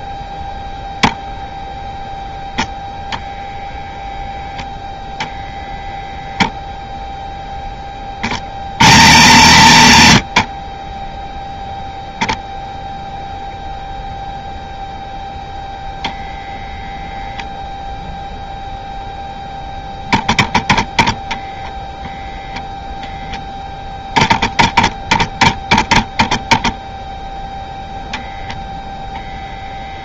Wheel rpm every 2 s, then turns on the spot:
0, 0, 0, 0, 130, 40, 0, 0, 0, 0, 20, 0, 10, 0, 0.
none